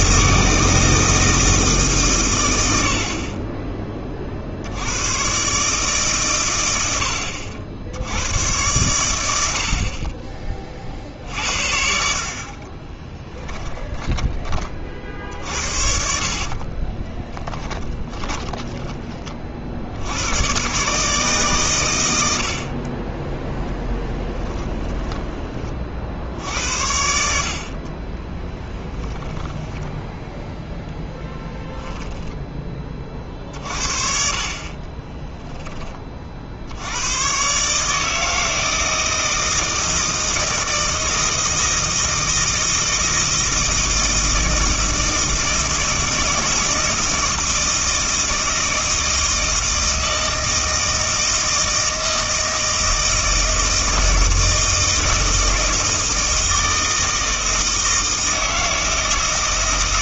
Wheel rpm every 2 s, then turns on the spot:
160, 80, 90, 90, 110, 40, 20, 40, 30, 20, 140, 30, 10, 60, 10, 10, 20, 40, 80, 160, 160, 160, 160, 160, 160, 160, 160, 160, 160, 160.
12-14 16-18 24-26 34-36